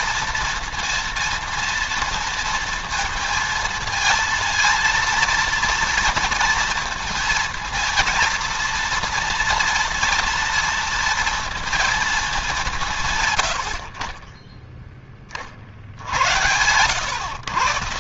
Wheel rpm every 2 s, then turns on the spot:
230, 230, 230, 220, 230, 230, 190, 20, 90.
none